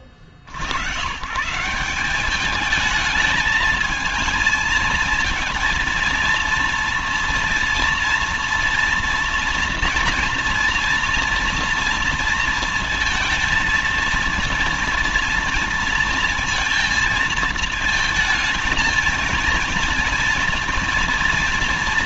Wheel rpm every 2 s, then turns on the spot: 60, 200, 220, 230, 230, 230, 230, 230, 230, 220, 230.
none